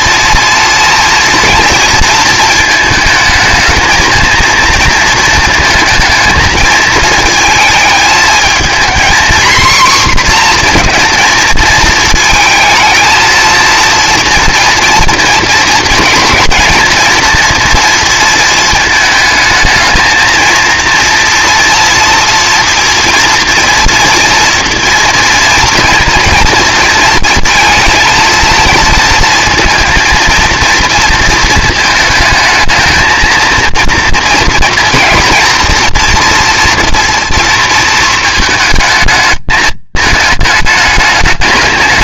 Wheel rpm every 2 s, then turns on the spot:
230, 220, 230, 220, 230, 250, 230, 230, 220, 220, 230, 230, 230, 230, 230, 230, 220, 230, 230, 220, 220.
none